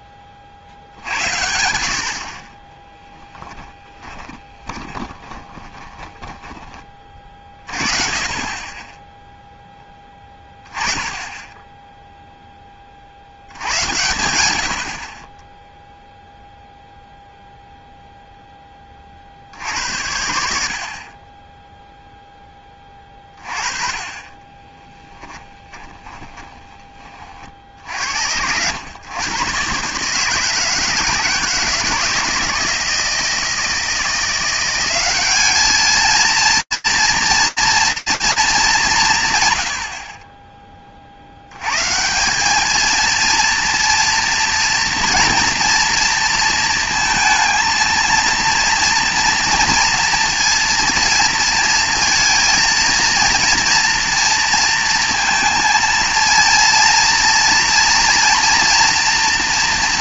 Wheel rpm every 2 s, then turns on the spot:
50, 30, 20, 20, 10, 20, 10, 80, 0, 10, 60, 10, 20, 20, 90, 160, 160, 180, 230, 210, 20, 200, 230, 230, 230, 230, 230, 230, 230, 230.
4-6 24-26